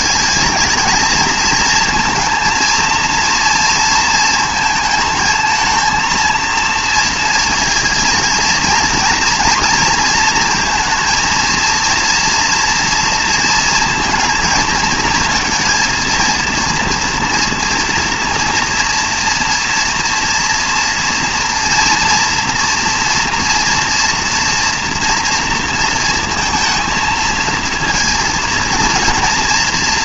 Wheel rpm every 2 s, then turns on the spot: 220, 230, 220, 230, 230, 230, 230, 230, 230, 230, 230, 240, 230, 230, 230.
none